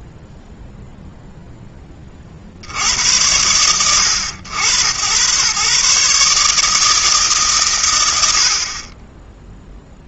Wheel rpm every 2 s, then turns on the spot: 0, 70, 130, 160, 30.
none